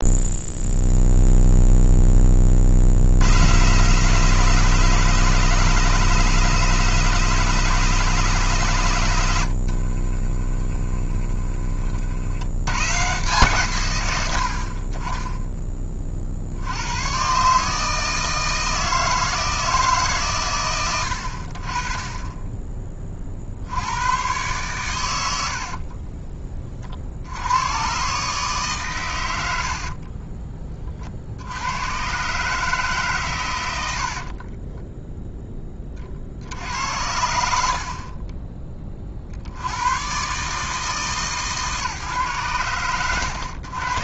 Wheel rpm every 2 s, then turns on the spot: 0, 60, 170, 170, 140, 30, 120, 30, 110, 160, 90, 20, 100, 50, 120, 30, 150, 10, 70, 40, 150, 90.
10-12 34-36